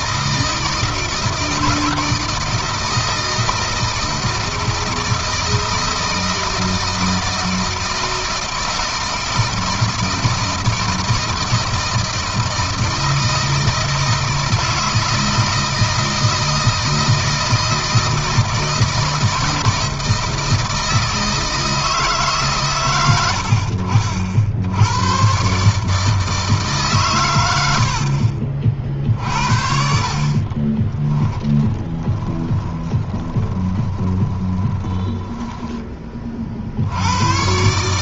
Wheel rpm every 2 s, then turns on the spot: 160, 160, 160, 160, 160, 160, 160, 160, 160, 160, 160, 130, 90, 140, 50, 30, 20, 20, 70.
30-36